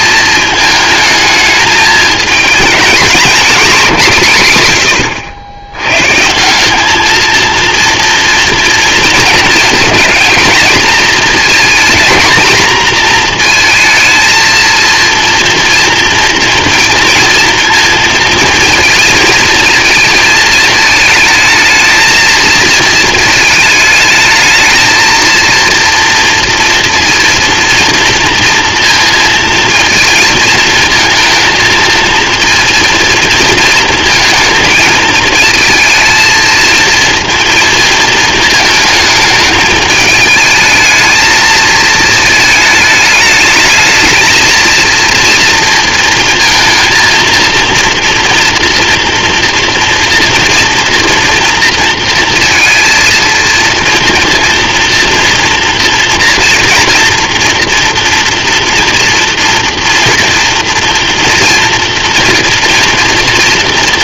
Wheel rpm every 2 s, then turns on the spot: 220, 240, 110, 220, 220, 230, 230, 230, 230, 230, 220, 220, 230, 230, 230, 230, 230, 220, 230, 220, 220, 210, 230, 230, 230, 230, 230, 230, 240, 230, 230, 230.
none